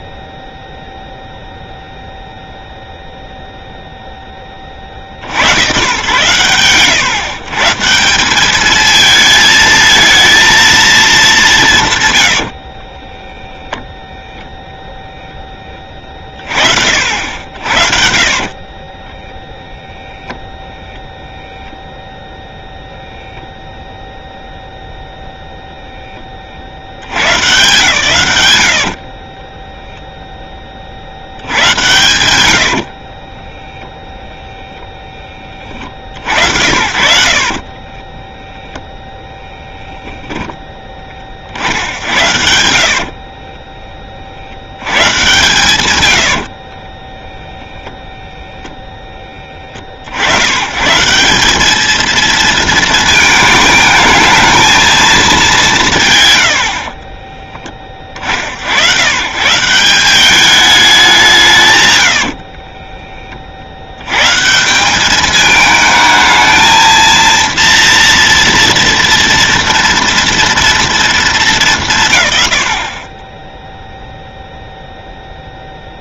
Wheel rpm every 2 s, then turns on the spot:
0, 0, 0, 120, 180, 220, 150, 0, 40, 40, 0, 0, 0, 70, 50, 40, 60, 20, 70, 0, 20, 80, 70, 70, 10, 120, 230, 220, 60, 70, 200, 50, 150, 220, 230, 230, 100, 0.
18-20 28-30 32-34 36-38 42-44 46-48 56-58 62-64